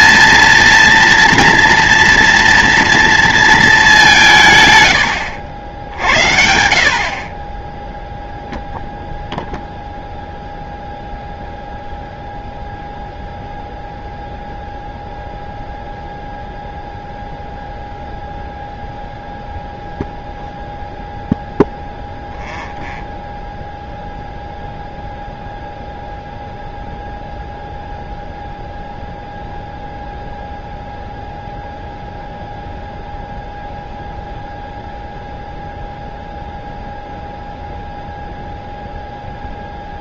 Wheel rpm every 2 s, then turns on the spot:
230, 230, 200, 70, 10, 0, 0, 0, 0, 0, 0, 0, 0, 0, 0, 0, 0, 0, 0, 0.
none